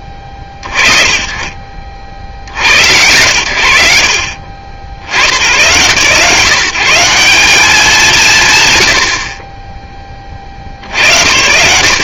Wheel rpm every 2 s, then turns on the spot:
30, 100, 70, 180, 120, 70.
none